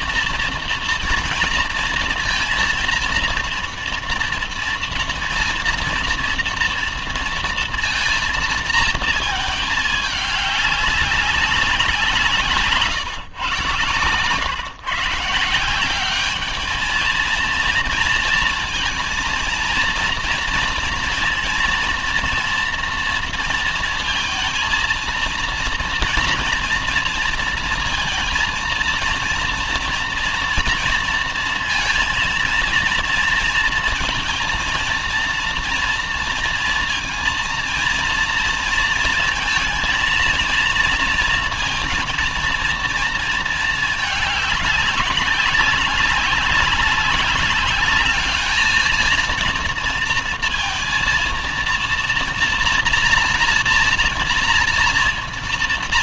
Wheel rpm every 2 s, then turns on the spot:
240, 230, 230, 230, 220, 200, 150, 140, 210, 230, 240, 240, 230, 240, 230, 230, 230, 230, 230, 230, 230, 230, 210, 200, 220, 230, 230, 230.
12-14